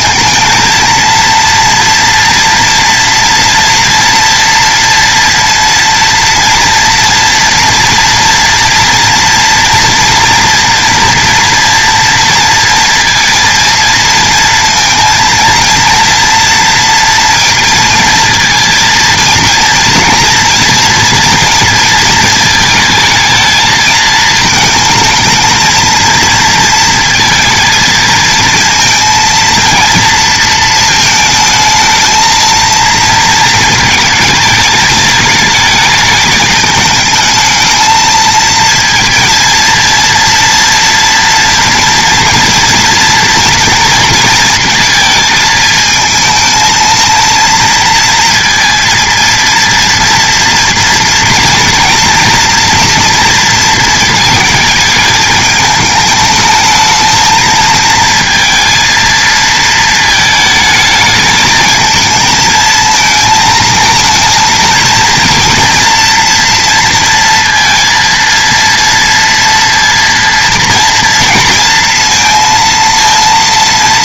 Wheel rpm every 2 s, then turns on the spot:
220, 230, 230, 230, 230, 230, 230, 230, 230, 230, 230, 220, 220, 230, 230, 220, 230, 220, 210, 230, 230, 230, 230, 230, 230, 230, 230, 220, 220, 230, 220, 220, 230, 230, 230, 230, 230.
none